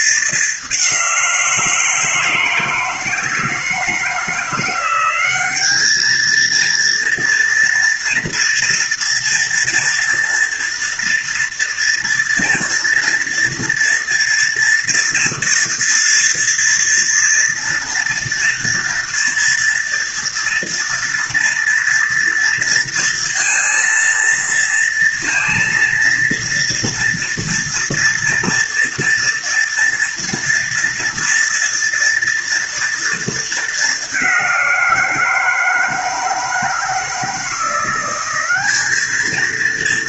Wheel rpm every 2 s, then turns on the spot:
180, 160, 190, 230, 230, 230, 230, 230, 240, 230, 230, 230, 230, 230, 230, 230, 220, 170, 170, 220.
none